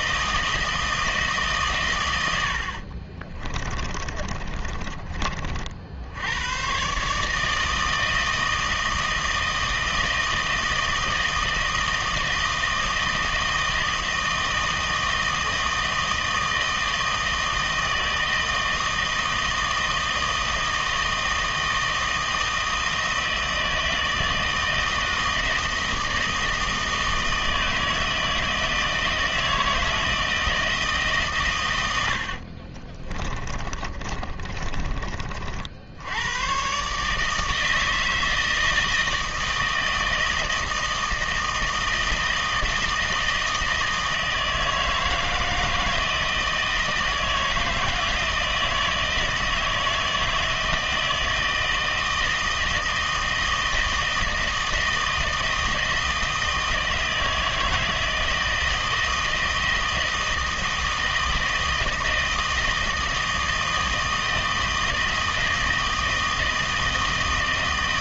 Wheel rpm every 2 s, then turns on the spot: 160, 80, 30, 100, 160, 160, 160, 160, 160, 160, 160, 160, 160, 160, 160, 160, 50, 30, 110, 160, 160, 160, 160, 160, 170, 160, 160, 160, 160, 160, 160, 160, 160, 160.
4-6 32-36